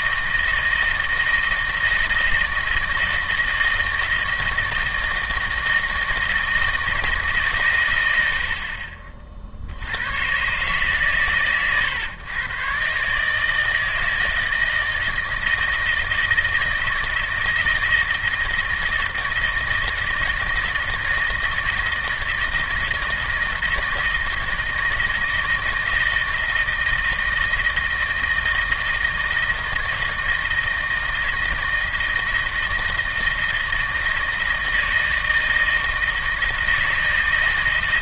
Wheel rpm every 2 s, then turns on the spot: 160, 160, 160, 160, 50, 140, 130, 160, 160, 160, 160, 160, 160, 160, 160, 160, 160, 170, 160.
none